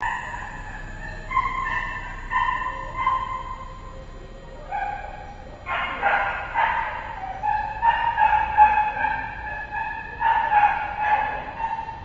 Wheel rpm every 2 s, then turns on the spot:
0, 0, 0, 0, 0, 0.
none